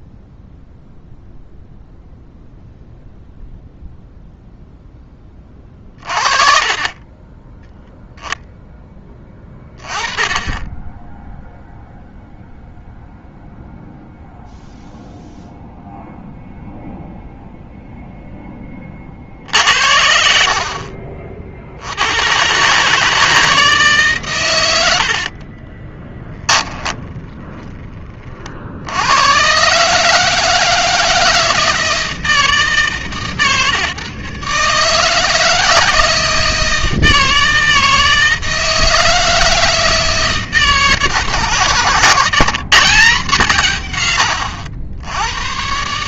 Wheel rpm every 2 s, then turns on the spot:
0, 0, 10, 30, 10, 10, 0, 0, 0, 30, 50, 150, 70, 10, 80, 160, 150, 150, 160, 160, 160, 170, 90.
6-8 24-26